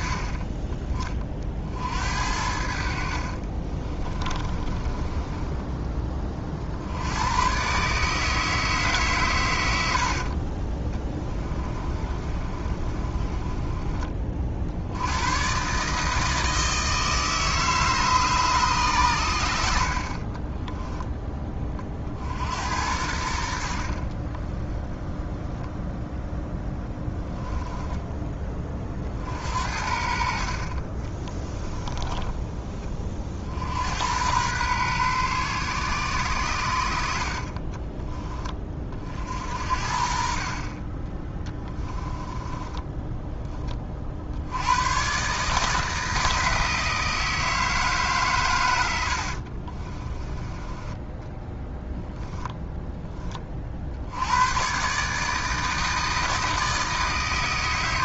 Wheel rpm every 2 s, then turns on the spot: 30, 60, 30, 70, 150, 20, 30, 70, 160, 140, 10, 80, 10, 0, 30, 40, 20, 120, 80, 30, 30, 10, 100, 160, 100, 20, 10, 120, 160.
2-6 10-14 20-22 30-32 42-44